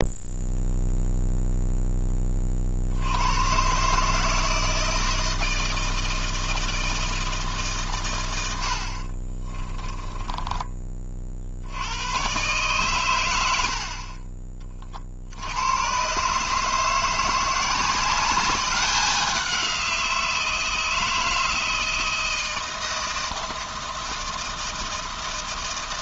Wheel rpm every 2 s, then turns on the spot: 0, 70, 160, 160, 70, 20, 120, 40, 160, 200, 160, 160, 160.
none